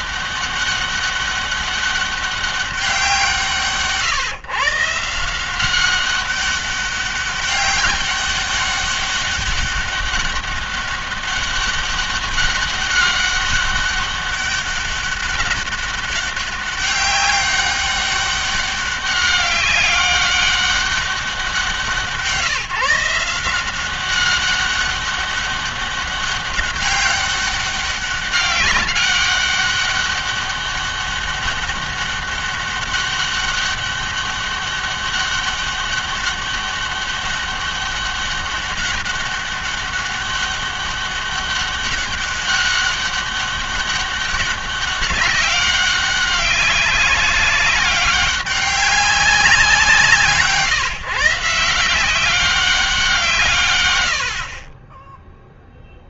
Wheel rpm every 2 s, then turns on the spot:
200, 190, 150, 200, 200, 200, 200, 200, 190, 200, 200, 160, 200, 200, 200, 200, 200, 200, 200, 200, 200, 200, 190, 190, 200, 160, 190, 40.
none